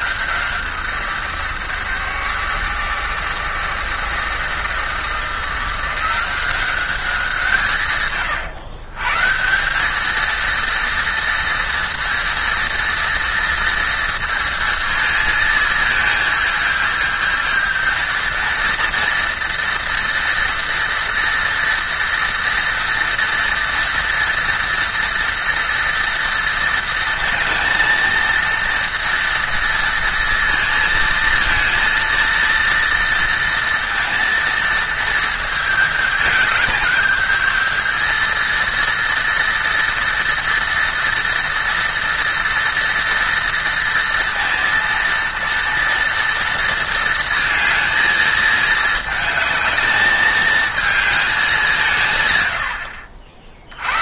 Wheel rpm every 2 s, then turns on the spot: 170, 150, 160, 190, 140, 230, 230, 220, 220, 230, 230, 230, 230, 220, 230, 230, 230, 220, 210, 230, 230, 230, 230, 230, 220, 220, 90.
none